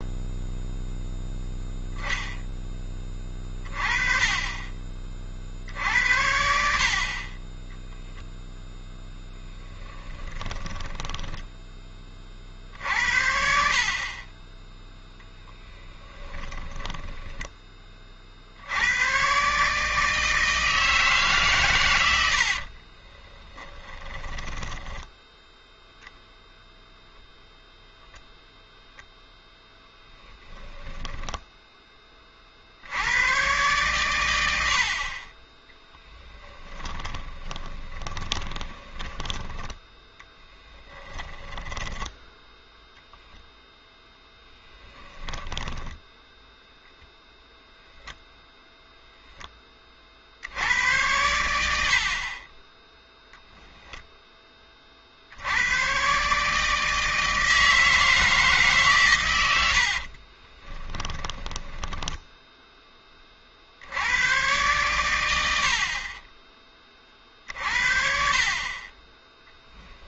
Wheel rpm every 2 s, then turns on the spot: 0, 20, 30, 60, 0, 20, 60, 10, 20, 80, 160, 50, 10, 0, 0, 10, 60, 70, 10, 20, 10, 0, 10, 0, 0, 80, 10, 30, 150, 150, 20, 10, 120, 30, 40.
10-12 16-18 22-26 30-32 36-42 44-46 60-62